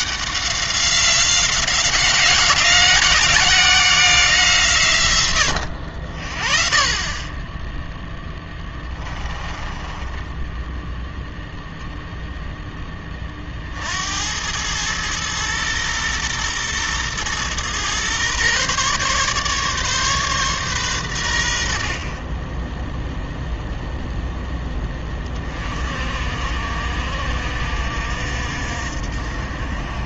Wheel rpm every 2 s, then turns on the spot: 190, 180, 150, 30, 20, 10, 10, 100, 120, 130, 120, 20, 10, 50, 60.
8-12